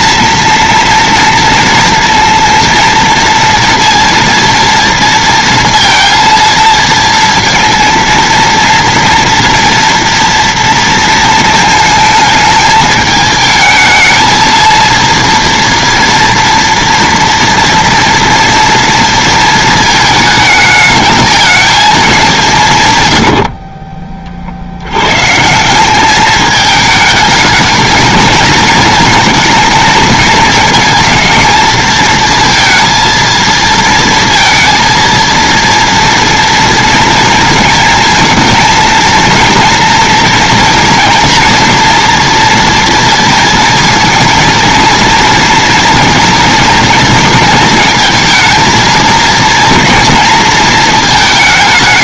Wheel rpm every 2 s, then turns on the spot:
230, 230, 230, 230, 230, 230, 220, 230, 230, 230, 220, 180, 60, 210, 230, 220, 230, 230, 230, 230, 240, 230, 230, 230, 230, 230.
none